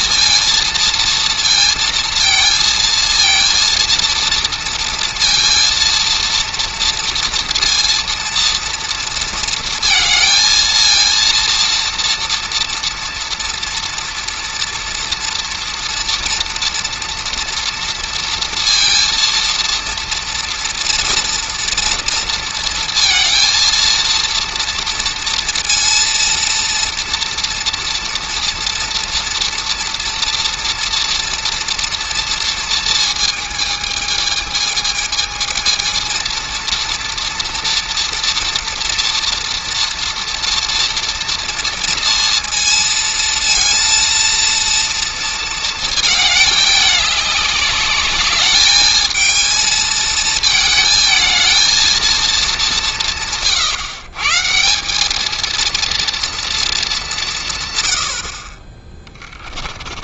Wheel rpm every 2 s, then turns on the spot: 230, 230, 230, 230, 230, 230, 230, 230, 230, 230, 230, 230, 230, 230, 230, 240, 230, 220, 230, 230, 230, 230, 230, 210, 210, 220, 190, 180, 210, 20.
58-60